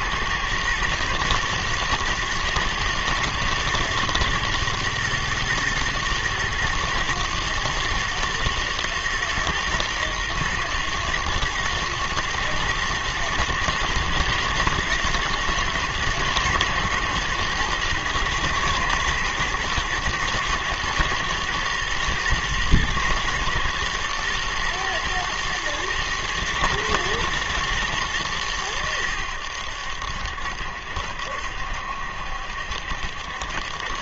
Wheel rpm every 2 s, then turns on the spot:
120, 120, 120, 110, 120, 120, 120, 110, 120, 110, 110, 120, 110, 120, 110, 70, 70.
none